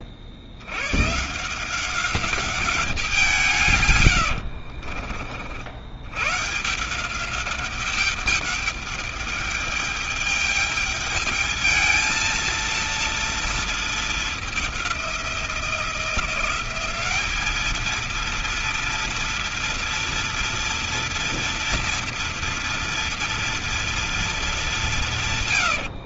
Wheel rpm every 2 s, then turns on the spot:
110, 190, 50, 170, 210, 210, 230, 200, 190, 230, 230, 230, 180.
4-6